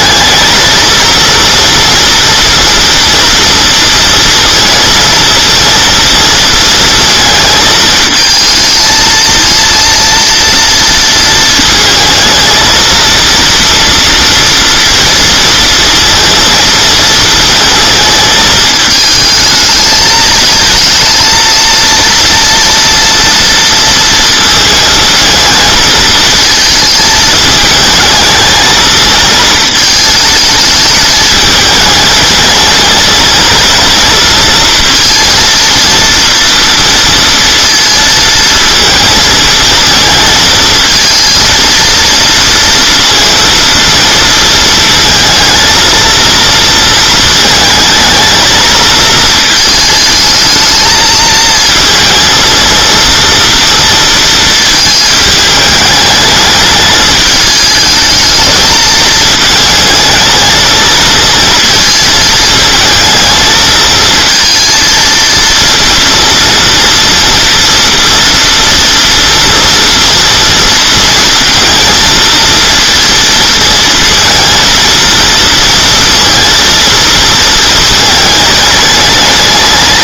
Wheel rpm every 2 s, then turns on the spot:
230, 230, 230, 230, 220, 230, 230, 230, 230, 220, 230, 230, 230, 220, 220, 210, 220, 230, 230, 230, 220, 230, 230, 230, 220, 220, 230, 220, 210, 220, 220, 220, 230, 230, 230, 230, 230, 230, 230, 210.
none